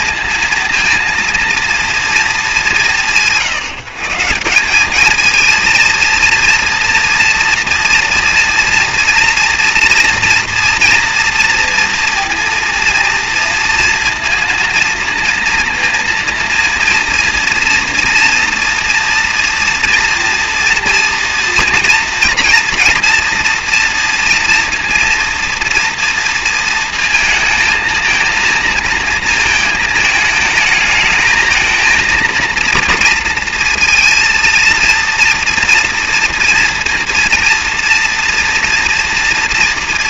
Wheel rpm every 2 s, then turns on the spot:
230, 200, 180, 230, 240, 230, 230, 230, 230, 230, 230, 230, 230, 230, 220, 220, 230, 230, 230, 230.
none